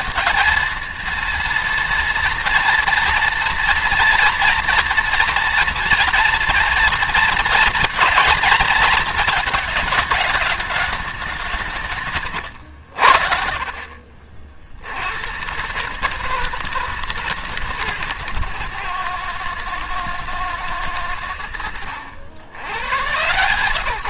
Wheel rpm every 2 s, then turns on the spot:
230, 230, 240, 230, 220, 210, 120, 70, 160, 120, 110, 100.
none